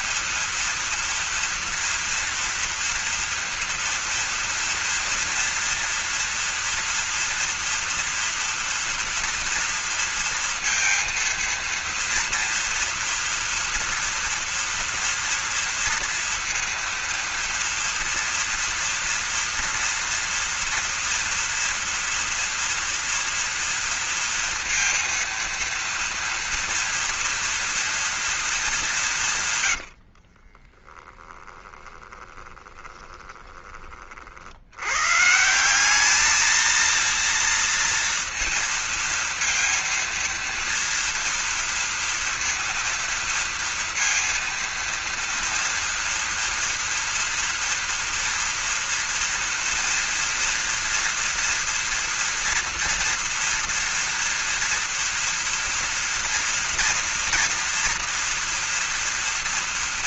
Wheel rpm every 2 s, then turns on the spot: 230, 230, 230, 240, 230, 230, 230, 230, 230, 230, 230, 240, 230, 230, 200, 20, 20, 100, 230, 230, 230, 230, 230, 230, 230, 230, 230, 230, 230, 230.
30-34